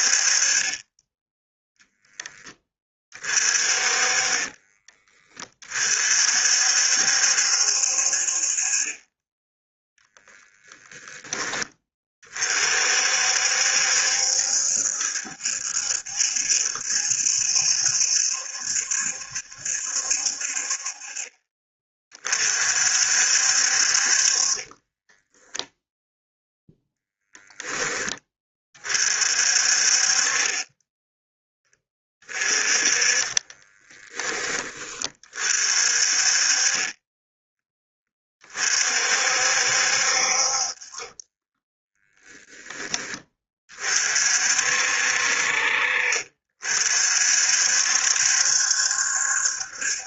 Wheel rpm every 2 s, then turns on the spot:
20, 30, 20, 60, 30, 20, 50, 70, 70, 70, 40, 60, 20, 0, 40, 10, 20, 30, 20, 50, 20, 10, 60, 50, 60.
0-2 10-12 24-26 32-34 36-38